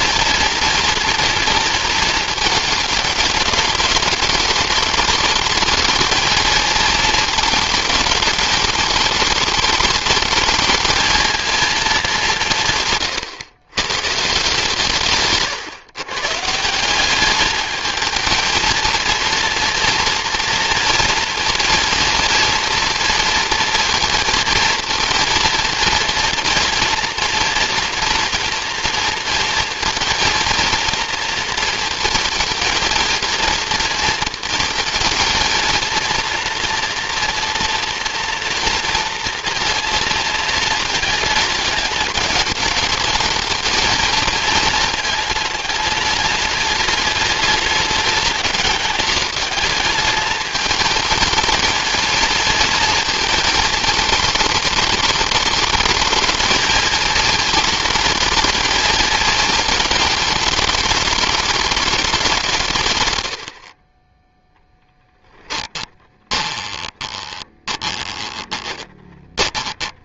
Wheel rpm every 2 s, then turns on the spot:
230, 220, 230, 230, 210, 220, 150, 150, 180, 230, 230, 230, 230, 240, 230, 230, 230, 220, 240, 230, 220, 220, 220, 210, 210, 220, 220, 200, 210, 220, 220, 150, 10, 10, 20.
66-70